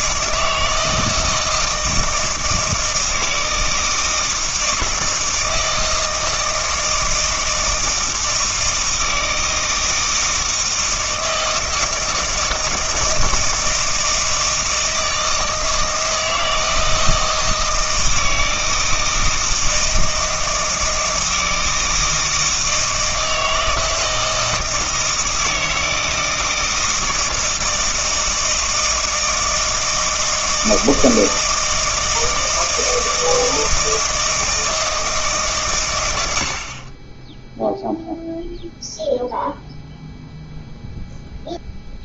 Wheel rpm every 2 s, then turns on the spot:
160, 160, 160, 160, 160, 160, 160, 160, 160, 160, 160, 160, 160, 160, 160, 160, 160, 160, 80, 0, 0.
none